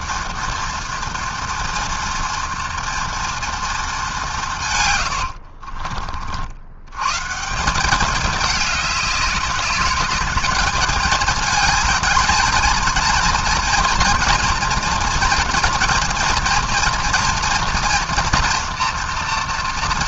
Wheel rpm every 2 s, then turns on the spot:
230, 230, 90, 140, 200, 220, 230, 230, 240, 240.
4-6